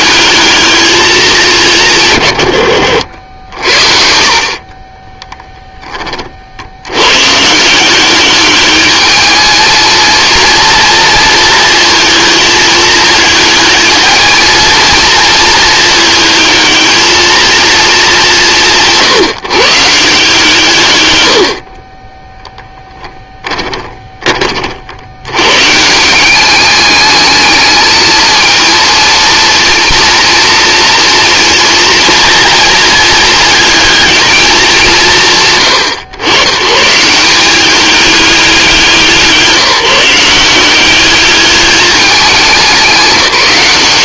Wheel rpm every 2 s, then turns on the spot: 210, 80, 30, 100, 210, 230, 220, 230, 220, 160, 120, 10, 70, 210, 230, 230, 230, 200, 140, 170, 200, 190.
22-24